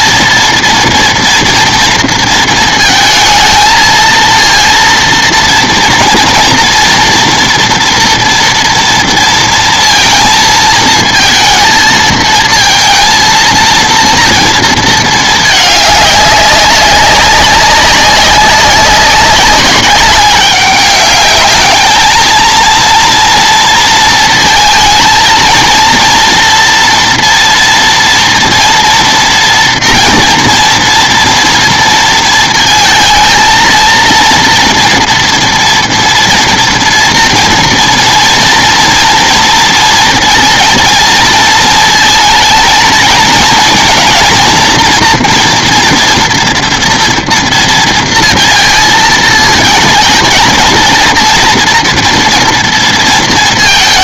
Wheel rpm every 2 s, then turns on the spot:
230, 230, 230, 230, 230, 230, 230, 230, 200, 190, 200, 230, 220, 230, 230, 230, 230, 230, 240, 240, 230, 220, 230, 240, 230, 230, 230.
none